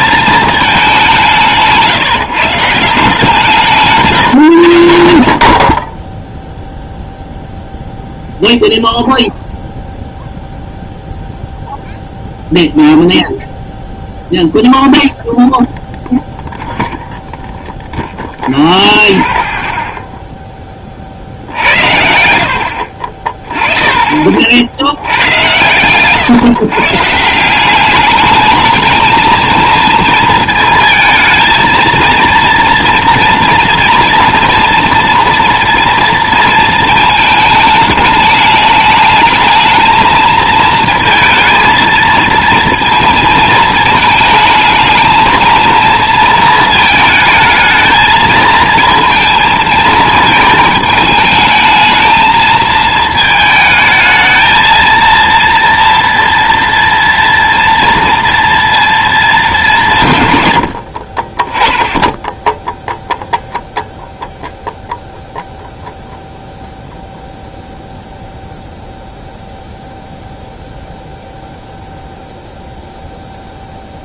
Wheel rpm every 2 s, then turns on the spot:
200, 160, 70, 0, 0, 0, 0, 0, 0, 0, 20, 70, 80, 140, 220, 230, 230, 230, 220, 210, 230, 230, 220, 220, 230, 220, 220, 230, 230, 230, 100, 0, 0, 0, 0, 0, 0.
22-24